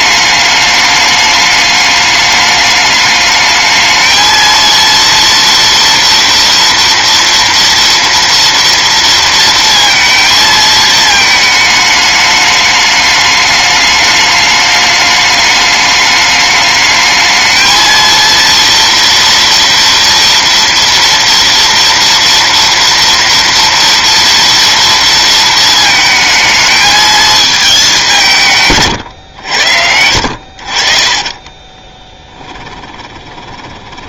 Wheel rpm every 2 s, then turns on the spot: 210, 210, 230, 230, 230, 220, 210, 210, 210, 230, 230, 230, 230, 220, 140, 50, 20.
30-34